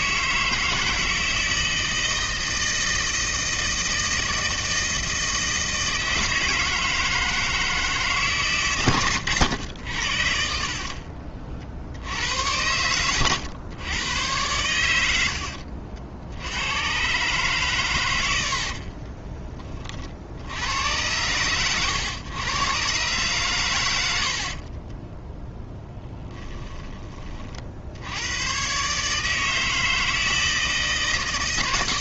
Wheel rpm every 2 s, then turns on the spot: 160, 160, 160, 160, 120, 50, 100, 100, 110, 50, 100, 130, 40, 20, 130, 160.
10-12 18-20 24-26